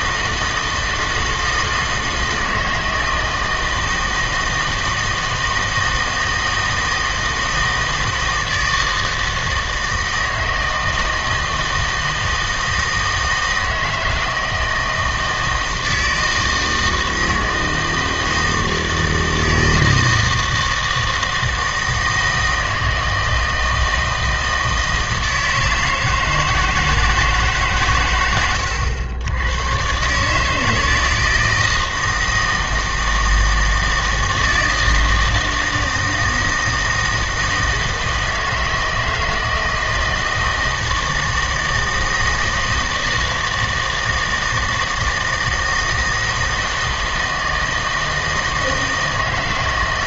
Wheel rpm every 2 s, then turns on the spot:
160, 160, 160, 160, 160, 160, 160, 160, 160, 160, 160, 160, 160, 160, 100, 160, 160, 160, 160, 160, 160, 160, 160, 160, 160.
none